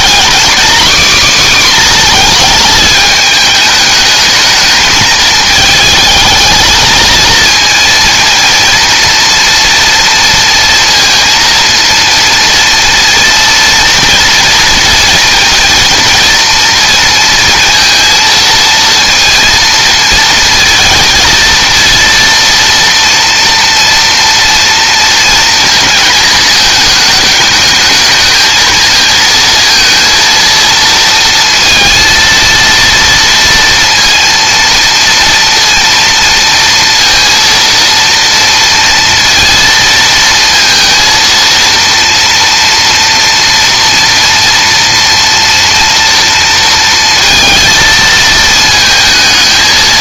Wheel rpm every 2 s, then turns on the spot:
260, 220, 220, 220, 230, 230, 230, 230, 230, 230, 220, 230, 230, 220, 230, 230, 230, 230, 230, 230, 230, 230, 230, 230, 220.
none